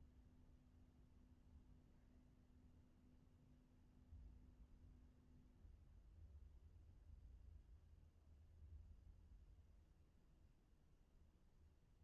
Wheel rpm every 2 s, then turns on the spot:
0, 0, 0, 0, 0, 0.
none